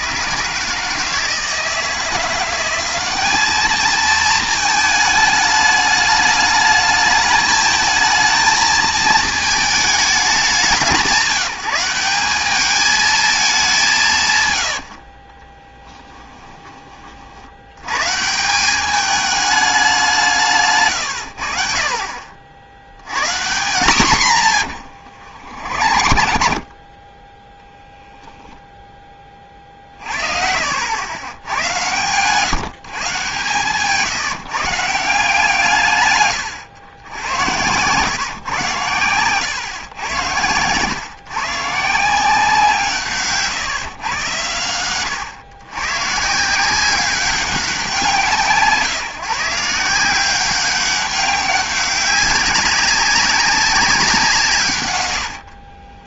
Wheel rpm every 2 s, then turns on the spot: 150, 190, 220, 210, 220, 200, 210, 110, 20, 190, 150, 70, 110, 50, 0, 80, 140, 150, 120, 120, 110, 170, 100, 160, 170, 190, 200, 150.
14-16 20-22 24-26 36-38